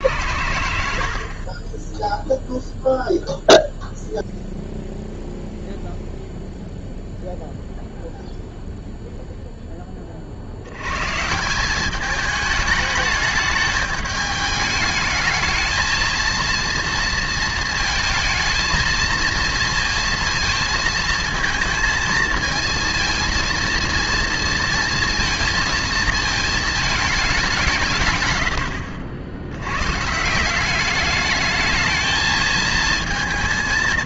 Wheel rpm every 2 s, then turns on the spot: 90, 0, 0, 0, 0, 90, 210, 210, 230, 220, 230, 230, 230, 220, 90, 180, 220.
none